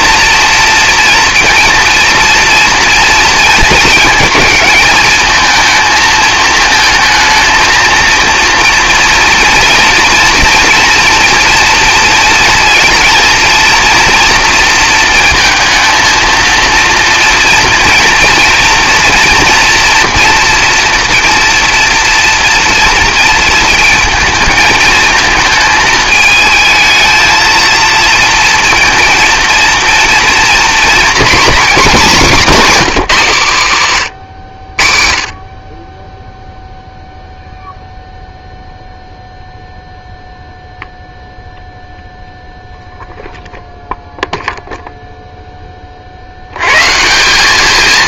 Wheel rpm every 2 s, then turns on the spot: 230, 230, 220, 220, 230, 240, 230, 230, 230, 230, 240, 230, 220, 220, 230, 240, 210, 50, 0, 0, 0, 0, 0, 130.
32-34